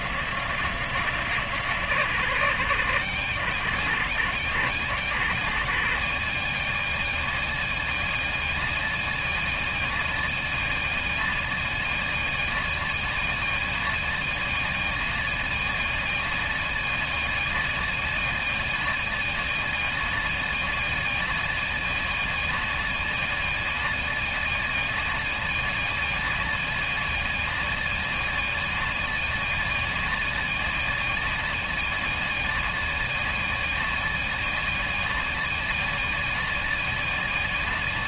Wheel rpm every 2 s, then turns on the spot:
130, 120, 130, 130, 130, 130, 130, 130, 130, 130, 130, 140, 140, 130, 130, 140, 130, 130, 130.
none